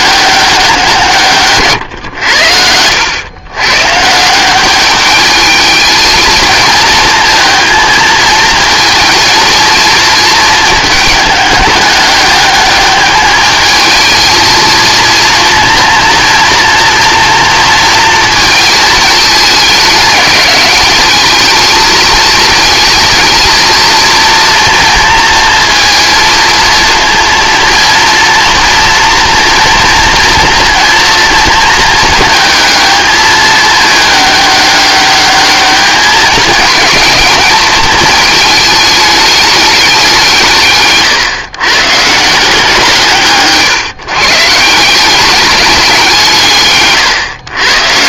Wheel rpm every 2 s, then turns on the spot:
190, 90, 190, 220, 220, 220, 210, 230, 240, 220, 200, 220, 230, 230, 230, 230, 220, 200, 220, 210, 140, 160, 160, 140.
2-4